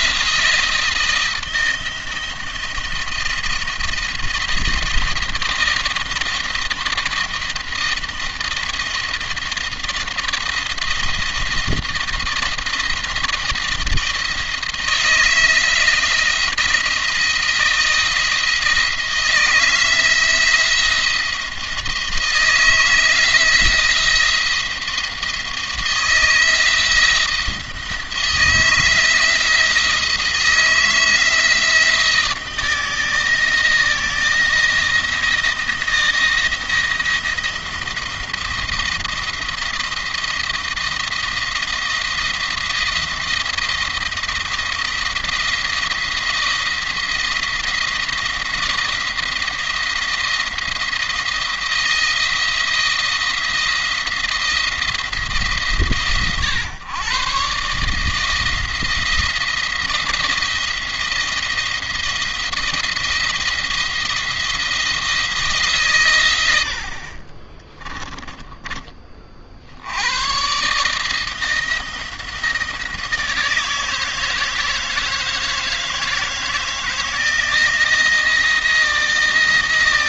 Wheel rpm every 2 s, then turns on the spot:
170, 170, 170, 170, 170, 170, 170, 170, 170, 170, 160, 160, 170, 170, 160, 160, 160, 170, 170, 170, 170, 160, 170, 170, 170, 170, 170, 160, 130, 170, 170, 170, 160, 60, 30, 150, 160, 160, 160, 170.
66-68